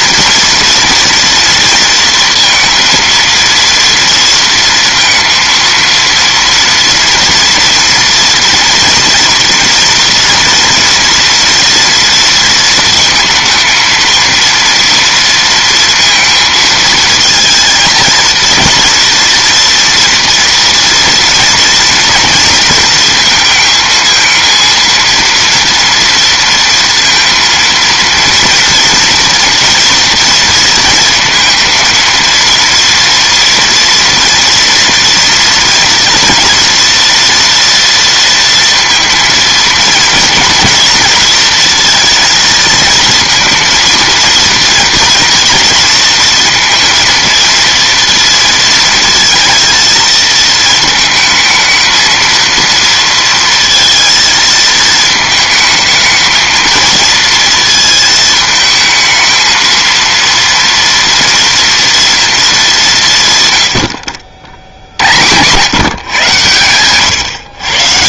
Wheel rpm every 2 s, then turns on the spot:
230, 230, 230, 230, 230, 230, 230, 230, 220, 230, 240, 230, 230, 230, 230, 230, 230, 230, 230, 230, 240, 230, 230, 230, 230, 220, 230, 220, 220, 220, 230, 210, 60, 120.
none